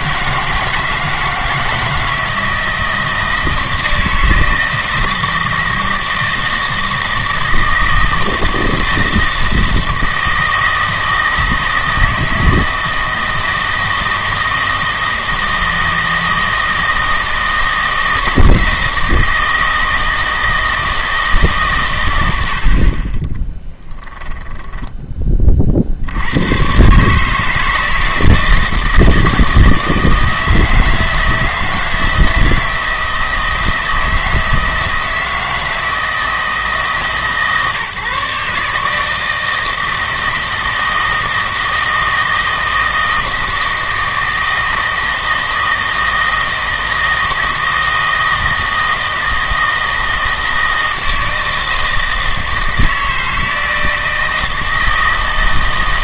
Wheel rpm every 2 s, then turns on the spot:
160, 160, 160, 160, 160, 160, 160, 160, 160, 160, 160, 50, 10, 130, 160, 160, 160, 160, 150, 150, 160, 160, 160, 160, 160, 160, 160, 160.
none